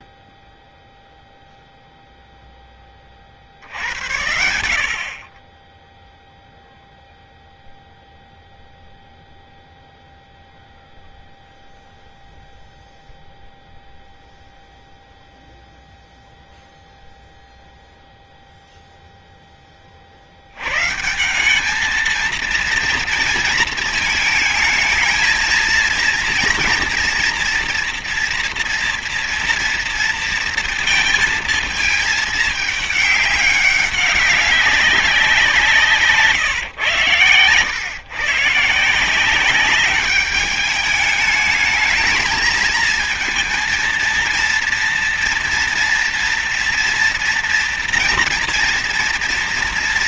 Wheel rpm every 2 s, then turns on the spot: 0, 0, 80, 0, 0, 0, 0, 0, 0, 0, 80, 230, 220, 240, 230, 230, 220, 200, 130, 140, 210, 230, 230, 230, 240.
none